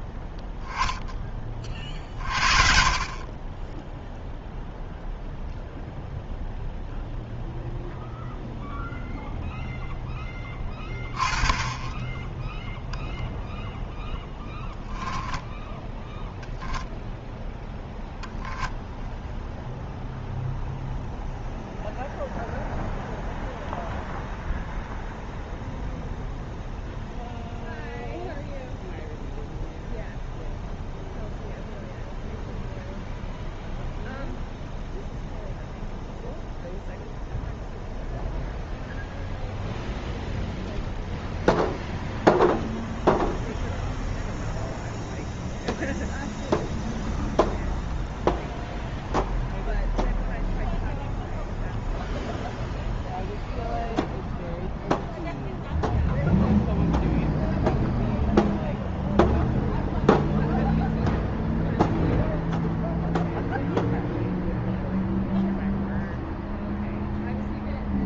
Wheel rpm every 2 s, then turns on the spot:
10, 50, 0, 0, 0, 10, 0, 10, 0, 0, 0, 0, 0, 0, 0, 0, 0, 0, 0, 0, 0, 0, 0, 0, 0, 0, 0, 0, 0, 0, 0, 0, 0, 0.
none